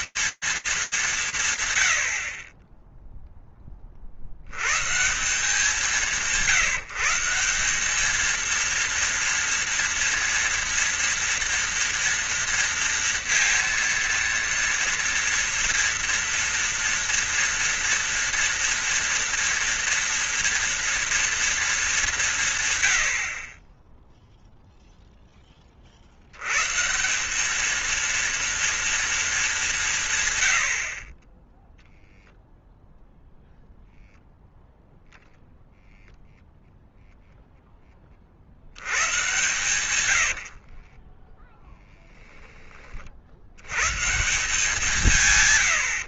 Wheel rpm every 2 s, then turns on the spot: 190, 0, 150, 170, 230, 230, 230, 230, 230, 230, 230, 110, 0, 170, 230, 40, 0, 0, 0, 90, 40, 30, 160.
40-42